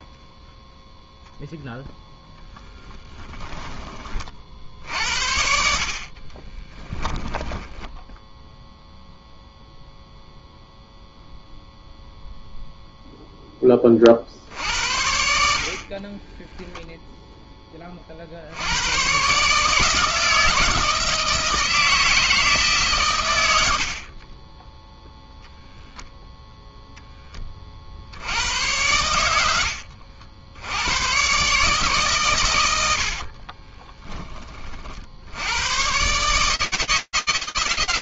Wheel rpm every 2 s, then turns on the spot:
0, 10, 60, 20, 0, 0, 0, 60, 10, 70, 160, 160, 20, 0, 80, 80, 110, 30, 150.
2-4 6-8 16-18